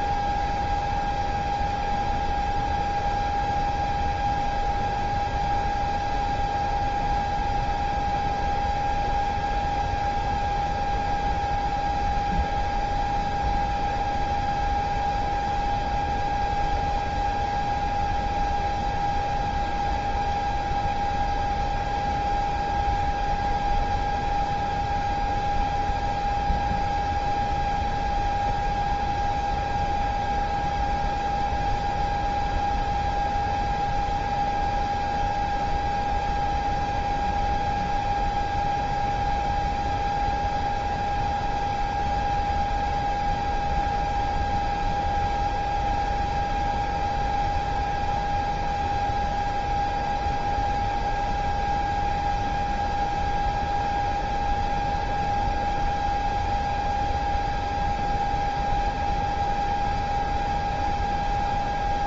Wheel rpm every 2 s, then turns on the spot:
0, 0, 0, 0, 0, 0, 0, 0, 0, 0, 0, 0, 0, 0, 0, 0, 0, 0, 0, 0, 0, 0, 0, 0, 0, 0, 0, 0, 0, 0, 0.
none